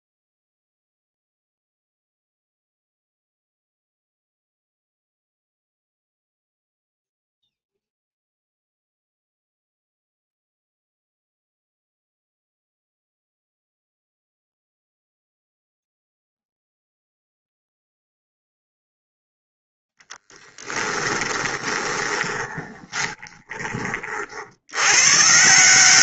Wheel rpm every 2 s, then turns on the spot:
0, 0, 0, 0, 0, 0, 0, 0, 0, 0, 10, 20, 60.
20-24